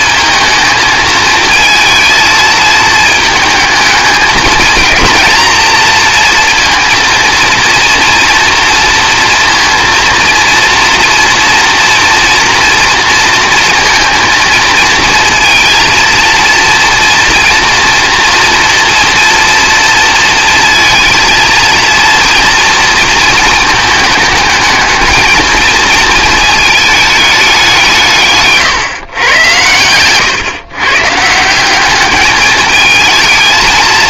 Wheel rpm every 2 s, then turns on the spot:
220, 220, 220, 230, 230, 230, 230, 220, 230, 230, 230, 230, 220, 220, 140, 130, 220.
none